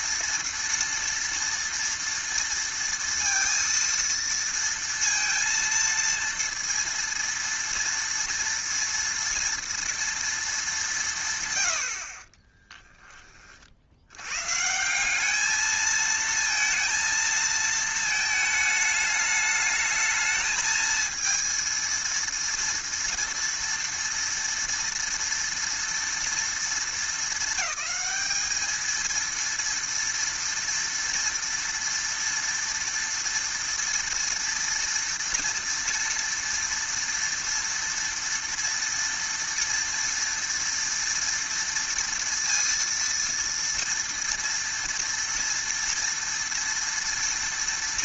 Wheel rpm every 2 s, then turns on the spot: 230, 230, 230, 230, 230, 200, 10, 160, 230, 210, 220, 230, 230, 230, 220, 230, 230, 230, 230, 230, 230, 230, 230, 230.
12-14